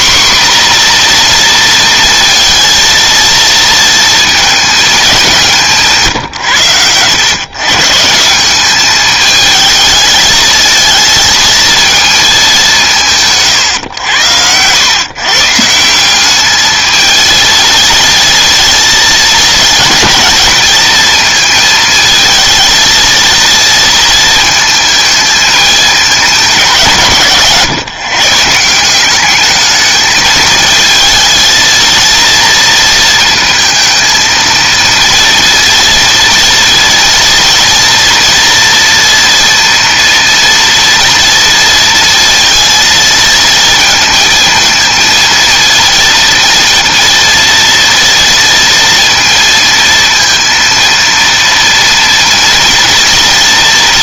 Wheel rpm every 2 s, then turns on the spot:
250, 230, 220, 120, 190, 220, 190, 100, 210, 220, 220, 230, 220, 200, 160, 220, 230, 230, 230, 230, 230, 230, 220, 230, 230, 230, 230.
none